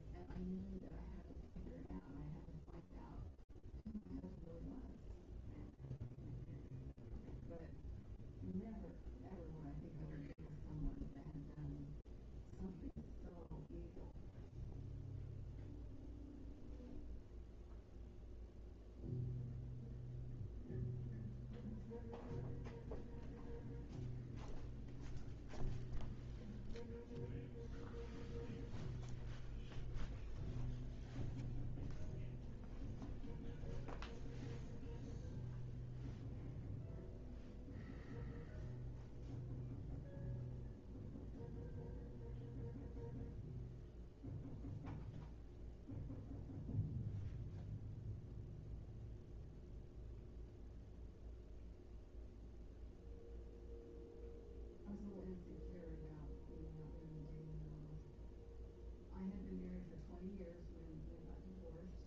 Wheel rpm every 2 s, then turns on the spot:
0, 0, 0, 0, 0, 0, 0, 0, 0, 0, 0, 0, 0, 0, 0, 0, 0, 0, 0, 0, 0, 0, 0, 0, 0, 0, 0, 0, 0, 0, 0.
none